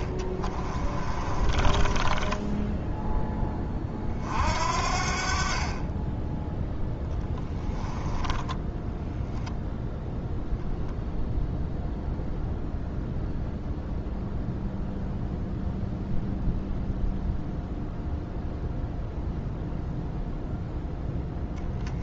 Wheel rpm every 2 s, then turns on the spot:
30, 10, 50, 10, 10, 0, 0, 0, 0, 0, 0.
0-4 8-10